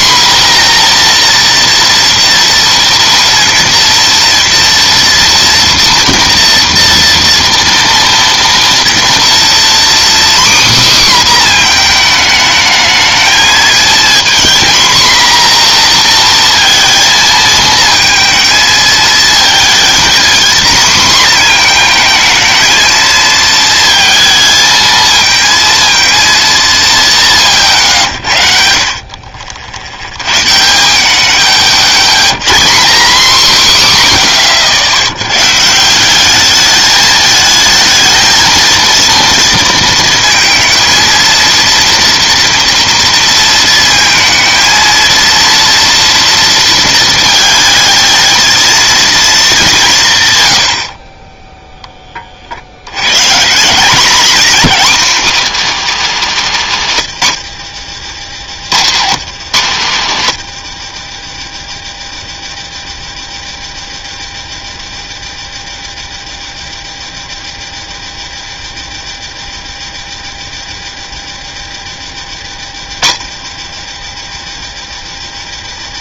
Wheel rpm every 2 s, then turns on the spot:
250, 230, 230, 230, 230, 270, 220, 240, 230, 220, 240, 230, 220, 170, 50, 120, 70, 50, 210, 230, 220, 230, 230, 230, 230, 80, 70, 220, 160, 90, 90, 40, 40, 40, 40, 40, 40, 30.
60-62